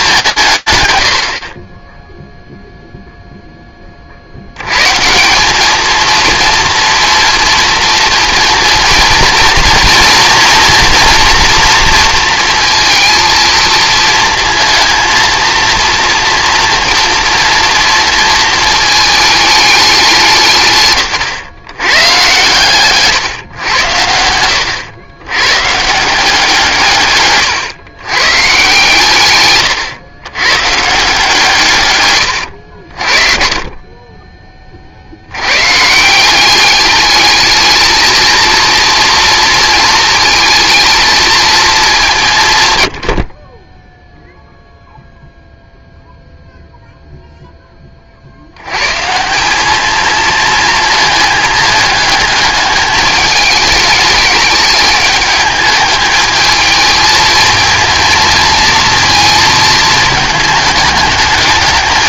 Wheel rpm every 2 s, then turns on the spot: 160, 0, 100, 230, 230, 240, 230, 230, 230, 220, 160, 130, 100, 170, 130, 140, 80, 60, 200, 230, 220, 90, 0, 0, 100, 220, 210, 210, 220, 230, 210.
none